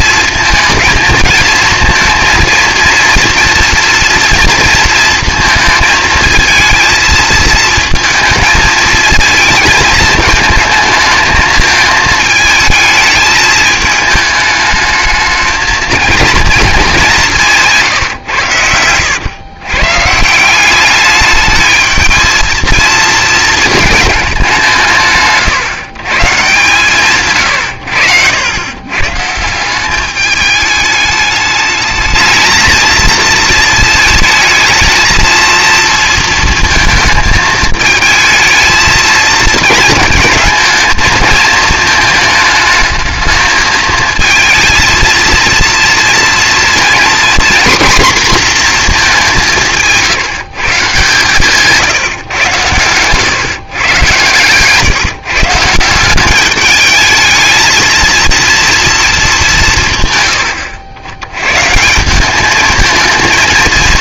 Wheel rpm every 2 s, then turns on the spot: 220, 230, 230, 230, 230, 220, 220, 220, 220, 100, 190, 230, 160, 150, 110, 210, 220, 220, 230, 220, 220, 220, 220, 230, 230, 150, 120, 140, 210, 230, 90, 220.
52-54